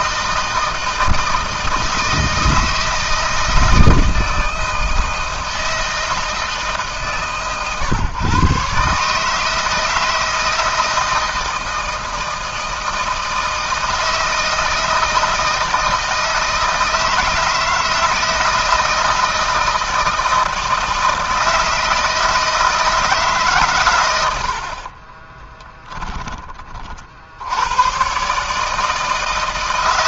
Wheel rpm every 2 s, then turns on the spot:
160, 160, 170, 160, 140, 160, 160, 160, 160, 160, 160, 160, 70, 30, 150.
24-26